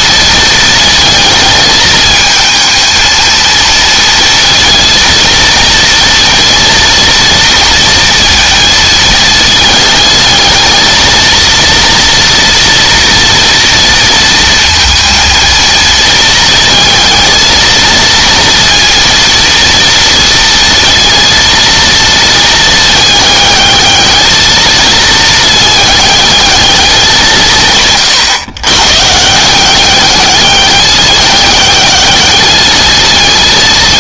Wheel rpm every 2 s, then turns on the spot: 230, 230, 230, 230, 230, 220, 230, 230, 220, 230, 230, 220, 220, 210, 120, 210, 220.
none